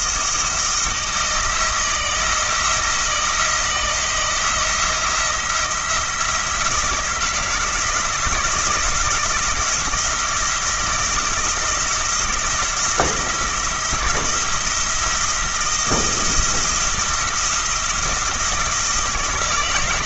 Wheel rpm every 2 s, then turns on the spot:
160, 160, 170, 170, 160, 170, 170, 170, 170, 170.
none